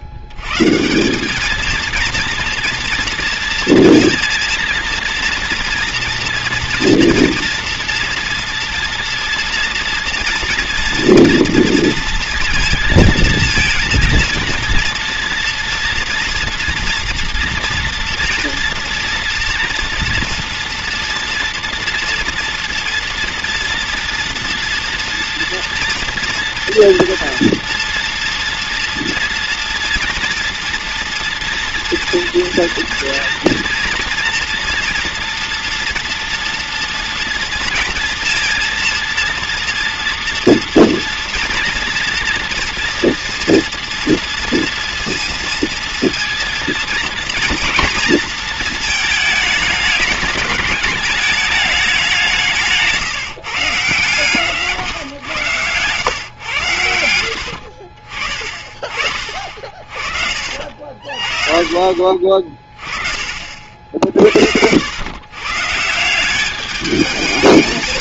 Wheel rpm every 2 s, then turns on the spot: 120, 230, 230, 240, 230, 230, 230, 230, 230, 230, 240, 230, 230, 230, 230, 230, 240, 230, 230, 230, 230, 230, 230, 230, 220, 210, 170, 140, 90, 40, 50, 30, 100, 210.
54-56 62-64